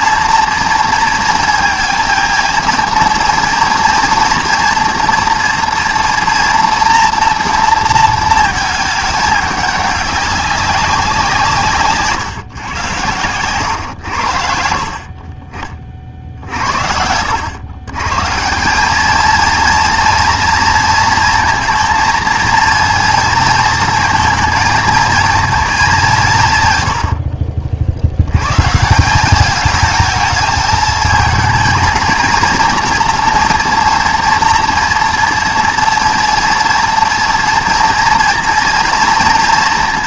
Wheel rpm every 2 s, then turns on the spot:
230, 230, 230, 230, 220, 200, 130, 70, 70, 200, 230, 230, 230, 120, 160, 220, 230, 230, 240, 230.
none